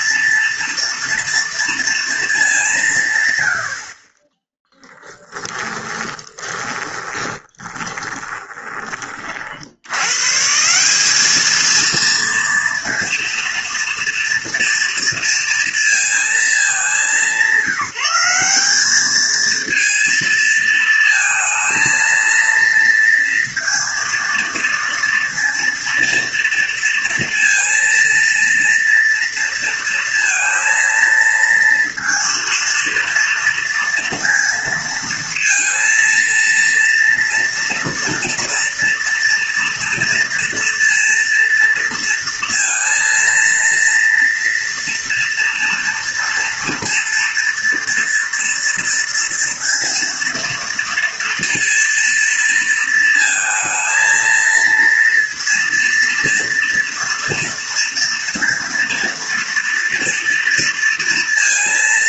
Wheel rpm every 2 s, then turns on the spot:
230, 140, 10, 20, 40, 200, 230, 230, 200, 210, 220, 230, 230, 230, 230, 230, 230, 230, 230, 230, 230, 230, 230, 230, 230, 230, 230, 230, 230, 230, 230.
4-8